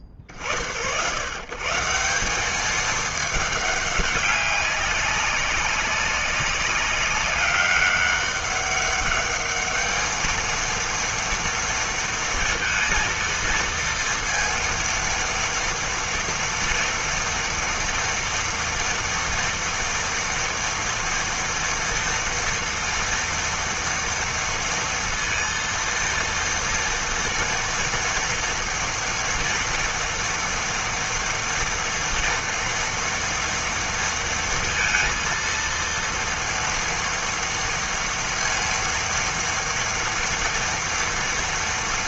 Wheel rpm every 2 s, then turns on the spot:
60, 200, 200, 190, 200, 230, 230, 230, 230, 230, 230, 230, 230, 230, 230, 230, 230, 230, 230, 230, 230.
none